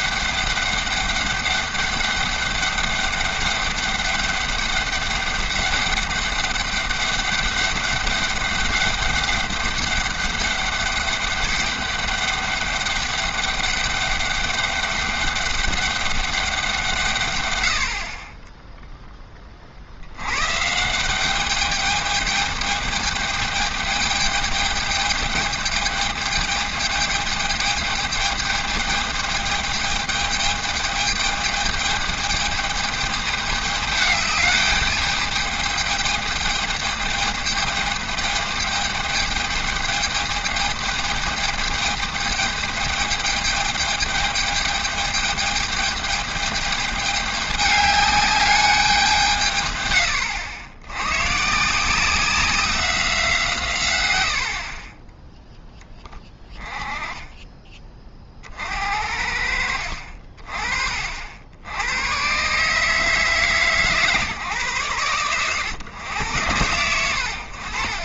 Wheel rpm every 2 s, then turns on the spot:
200, 200, 200, 200, 200, 200, 200, 200, 190, 10, 140, 210, 210, 210, 220, 220, 220, 210, 210, 210, 210, 220, 210, 210, 200, 90, 190, 50, 20, 60, 40, 140, 130, 100.
54-58